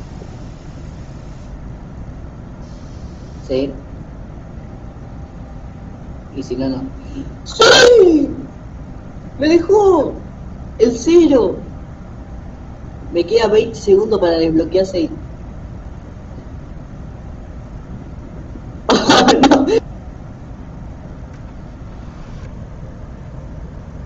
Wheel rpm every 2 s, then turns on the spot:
0, 0, 0, 0, 0, 0, 0, 0, 0, 0, 0, 0.
none